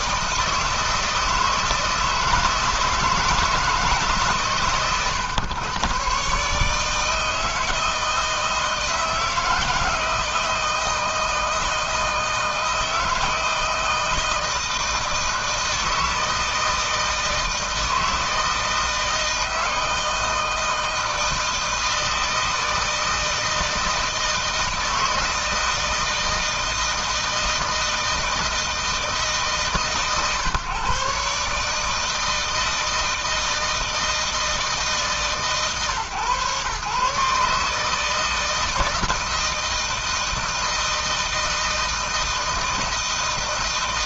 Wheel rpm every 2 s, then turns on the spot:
160, 160, 130, 140, 170, 160, 160, 160, 160, 160, 160, 160, 160, 160, 160, 140, 160, 160, 130, 160, 160, 160.
none